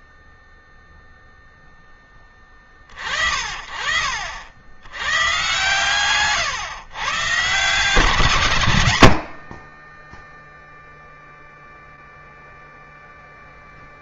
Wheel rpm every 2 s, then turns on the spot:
0, 50, 100, 130, 90, 0, 0.
2-4